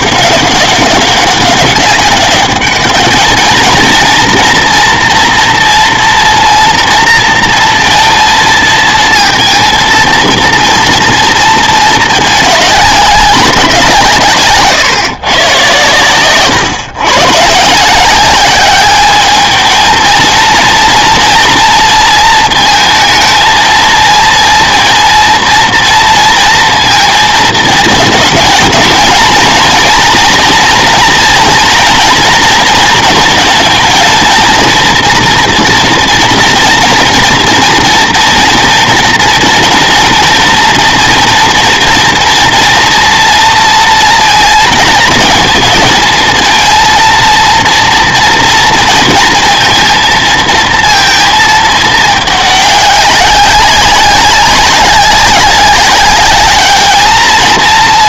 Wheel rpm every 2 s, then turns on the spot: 200, 210, 230, 230, 230, 230, 210, 130, 130, 200, 230, 220, 230, 230, 230, 230, 230, 230, 230, 230, 230, 240, 230, 220, 230, 230, 210, 190, 210.
14-16